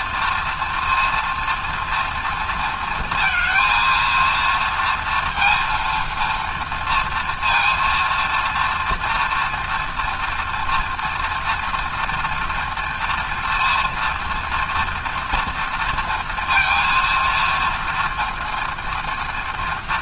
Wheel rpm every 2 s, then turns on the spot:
230, 230, 230, 230, 230, 230, 230, 240, 230, 230.
none